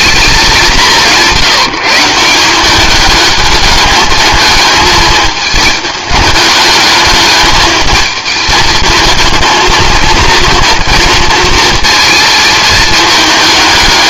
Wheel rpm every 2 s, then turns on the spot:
180, 210, 210, 210, 220, 230, 220.
none